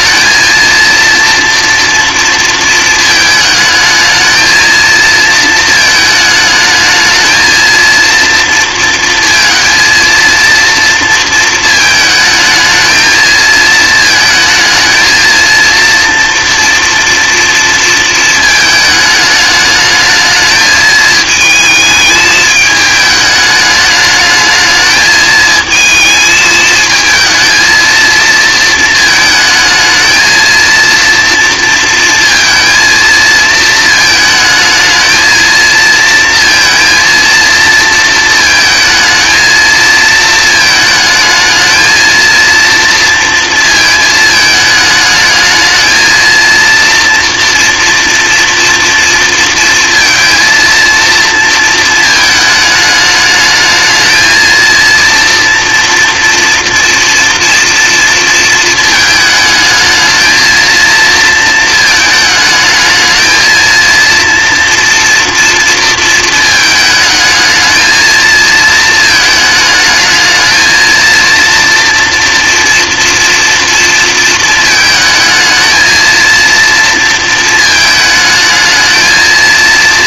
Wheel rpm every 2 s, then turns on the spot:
230, 230, 220, 220, 230, 230, 220, 220, 240, 220, 220, 210, 210, 220, 220, 230, 230, 220, 230, 230, 220, 240, 220, 230, 240, 230, 220, 230, 230, 230, 230, 220, 230, 220, 220, 220, 230, 220, 230, 220.
none